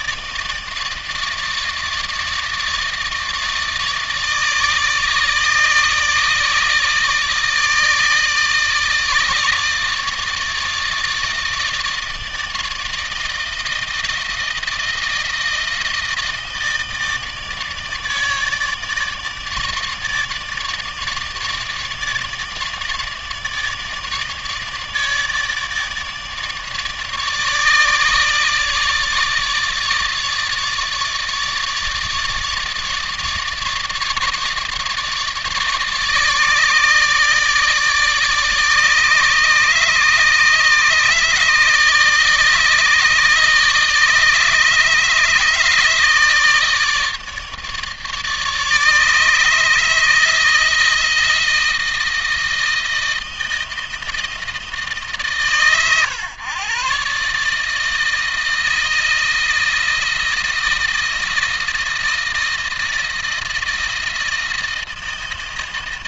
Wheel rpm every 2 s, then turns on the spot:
160, 150, 150, 150, 160, 160, 160, 160, 160, 150, 150, 150, 150, 150, 150, 150, 150, 150, 150, 150, 150, 150, 150, 150, 150, 160, 160, 150, 130, 160, 160, 160, 160.
none